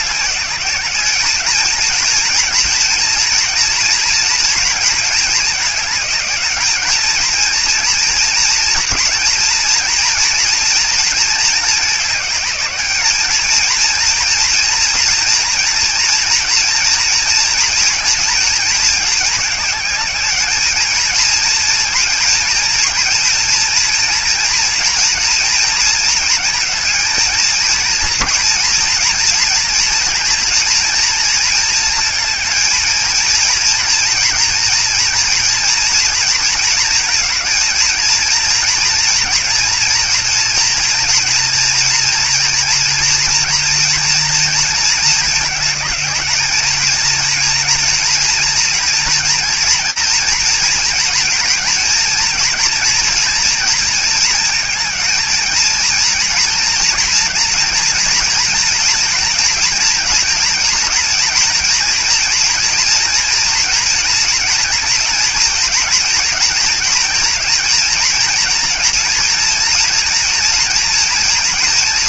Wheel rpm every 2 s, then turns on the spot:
200, 230, 230, 220, 230, 230, 210, 230, 230, 220, 220, 230, 230, 220, 240, 230, 230, 230, 230, 230, 230, 240, 230, 220, 230, 230, 230, 230, 230, 230, 230, 230, 230, 220, 230, 230.
none